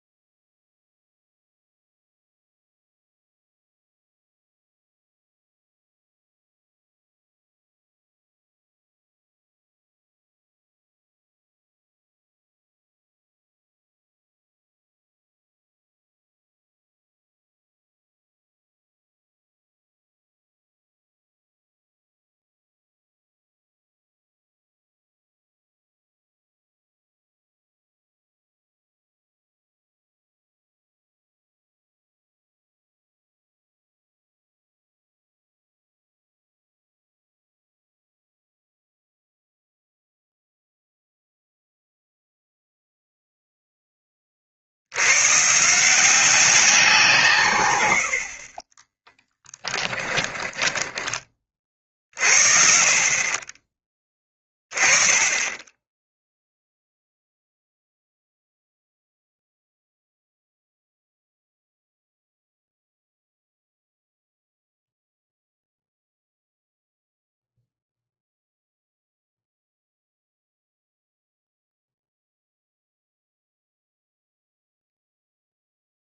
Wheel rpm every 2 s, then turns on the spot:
0, 0, 0, 0, 0, 0, 0, 0, 0, 0, 0, 0, 0, 0, 0, 0, 0, 0, 0, 0, 0, 0, 70, 180, 30, 20, 50, 20, 0, 0, 0, 0, 0, 0, 0, 0, 0, 0.
48-52